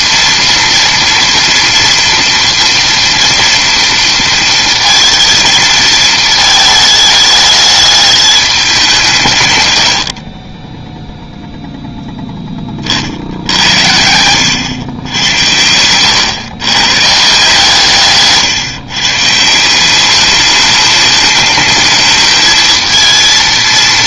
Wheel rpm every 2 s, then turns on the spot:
240, 230, 230, 220, 210, 30, 20, 110, 110, 140, 210, 220.
none